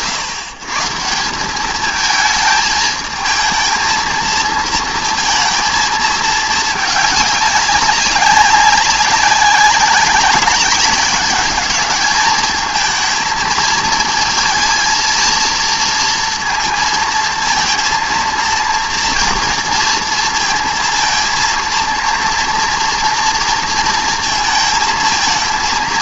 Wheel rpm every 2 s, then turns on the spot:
140, 220, 230, 210, 200, 200, 220, 230, 230, 230, 230, 230, 230.
none